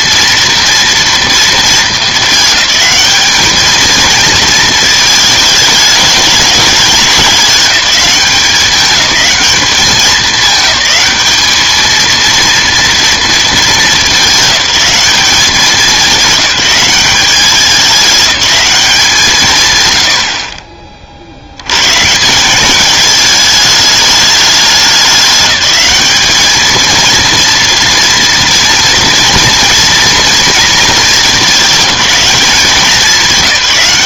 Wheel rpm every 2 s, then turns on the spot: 230, 210, 220, 200, 200, 210, 230, 210, 190, 200, 50, 190, 210, 220, 230, 230, 200.
none